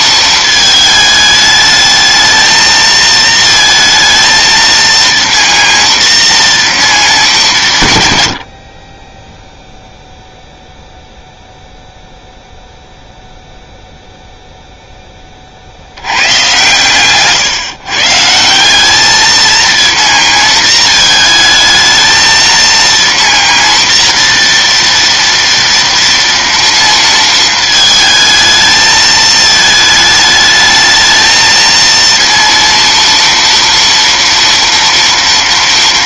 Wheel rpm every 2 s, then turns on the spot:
220, 220, 230, 230, 50, 0, 0, 0, 120, 190, 230, 230, 230, 230, 220, 220, 230, 230.
none